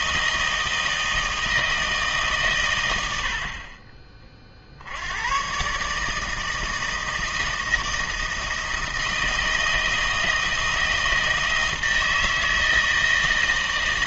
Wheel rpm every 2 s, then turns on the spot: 160, 120, 50, 160, 160, 160, 160.
none